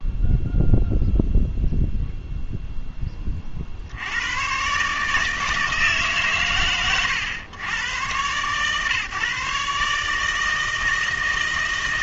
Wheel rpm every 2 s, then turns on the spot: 0, 0, 130, 120, 130, 160.
none